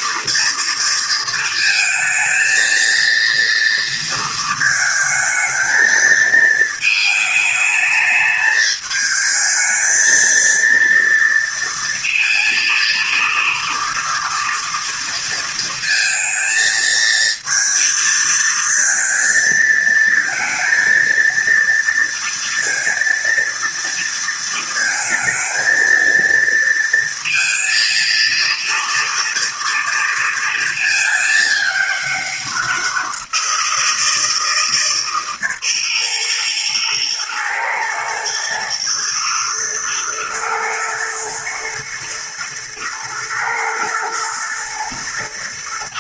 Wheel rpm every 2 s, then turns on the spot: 230, 230, 220, 220, 220, 230, 230, 230, 230, 230, 220, 230, 230, 230, 230, 230, 190, 160, 120, 120, 120, 110, 110.
none